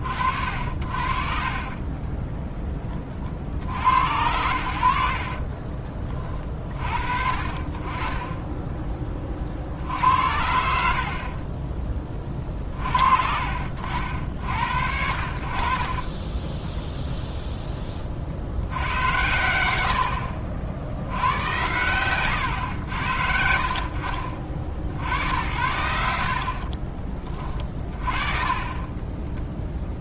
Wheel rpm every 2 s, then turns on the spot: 50, 10, 80, 40, 10, 70, 40, 70, 10, 80, 70, 100, 60, 30, 30.
16-18 26-30